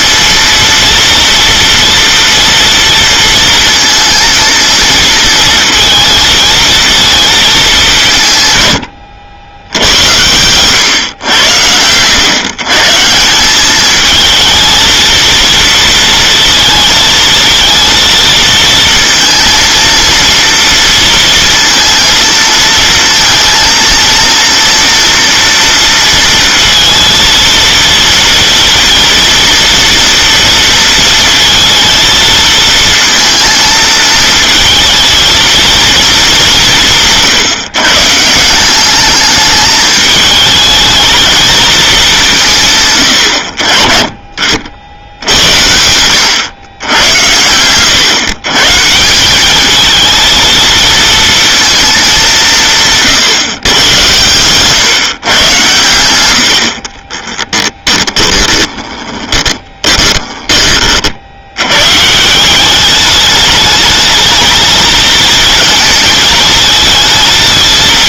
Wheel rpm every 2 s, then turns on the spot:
230, 230, 230, 230, 140, 100, 130, 220, 230, 230, 230, 230, 230, 230, 230, 230, 220, 220, 200, 160, 220, 190, 40, 110, 130, 220, 180, 120, 80, 10, 20, 170, 220, 220.
58-60